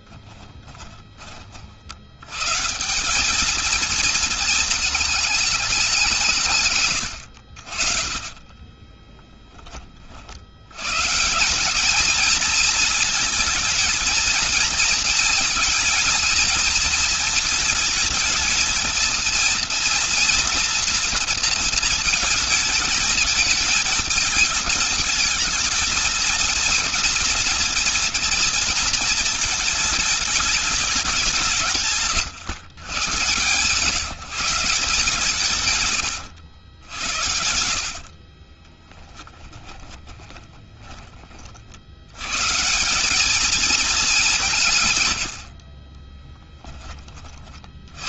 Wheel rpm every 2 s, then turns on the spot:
20, 170, 220, 130, 20, 110, 230, 230, 230, 230, 220, 210, 220, 230, 230, 200, 120, 160, 90, 40, 20, 170, 150, 10.
0-2 8-10 38-42